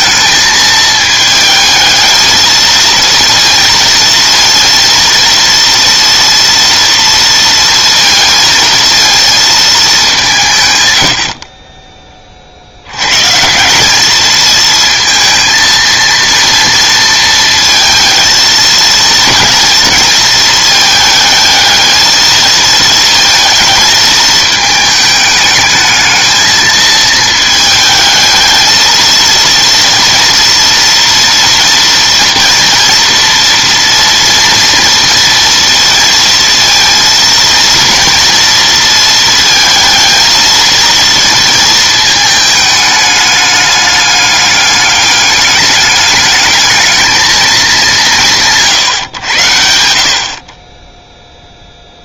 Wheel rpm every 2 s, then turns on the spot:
220, 230, 230, 230, 230, 150, 70, 220, 230, 230, 220, 230, 220, 220, 220, 230, 230, 230, 230, 230, 230, 210, 210, 220, 150, 20.
none